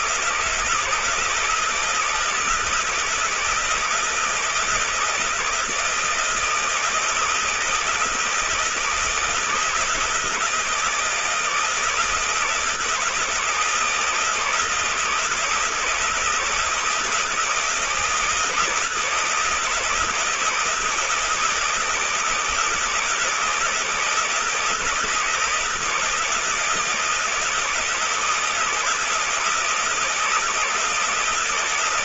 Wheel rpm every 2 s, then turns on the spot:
160, 160, 160, 160, 160, 160, 170, 160, 160, 160, 170, 160, 160, 160, 160, 160.
none